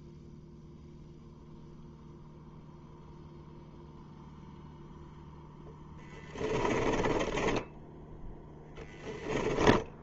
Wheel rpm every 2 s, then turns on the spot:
0, 0, 0, 20, 10.
6-8